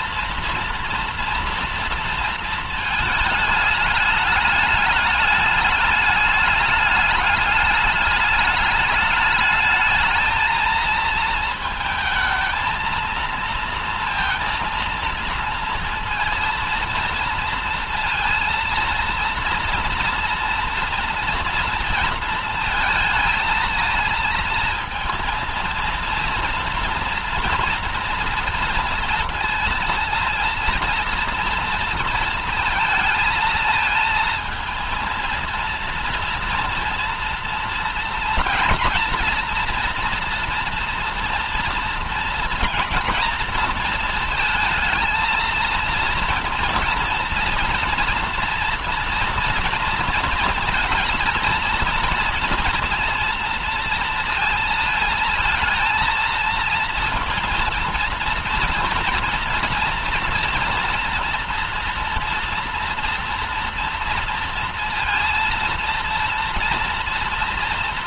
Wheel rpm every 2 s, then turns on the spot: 230, 220, 210, 210, 210, 220, 230, 230, 230, 230, 230, 230, 230, 230, 230, 230, 220, 230, 230, 240, 230, 230, 220, 230, 240, 230, 230, 230, 230, 230, 230, 240, 230, 230.
none